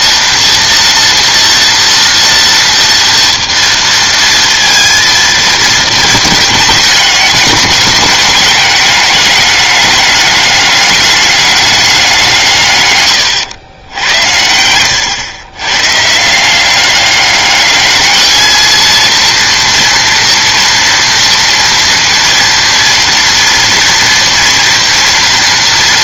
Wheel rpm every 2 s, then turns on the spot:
230, 230, 230, 210, 200, 200, 150, 90, 190, 220, 230, 230, 230.
14-16